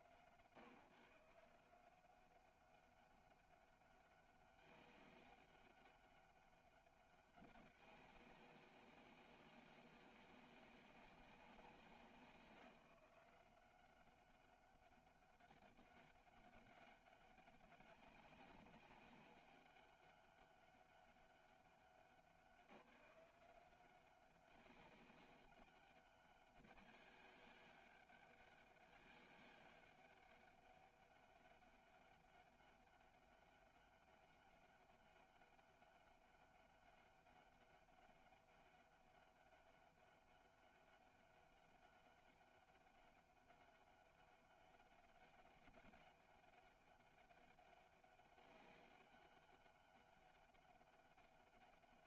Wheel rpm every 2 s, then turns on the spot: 150, 200, 200, 200, 190, 190, 180, 200, 200, 200, 200, 180, 200, 200, 200, 200, 200, 200, 200, 200, 200, 200, 200, 200, 190, 200.
none